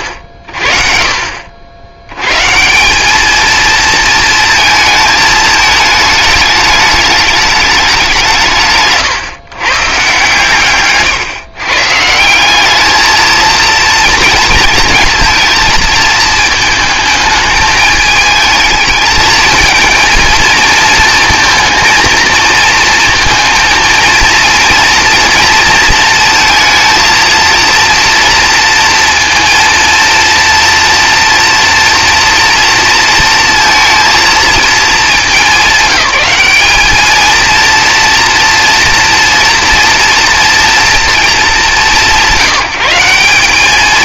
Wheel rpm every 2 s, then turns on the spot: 60, 160, 220, 210, 150, 140, 210, 230, 220, 220, 230, 230, 230, 230, 230, 230, 230, 220, 210, 230, 230, 160.
none